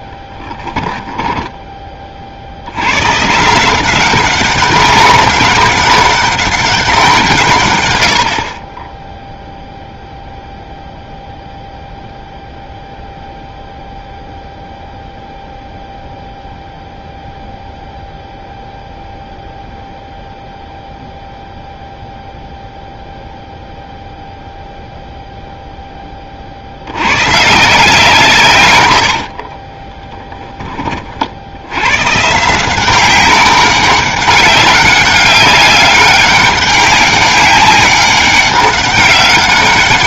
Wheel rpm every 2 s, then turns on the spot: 10, 110, 200, 190, 20, 0, 0, 0, 0, 0, 0, 0, 0, 80, 120, 30, 180, 200, 200, 200.
28-30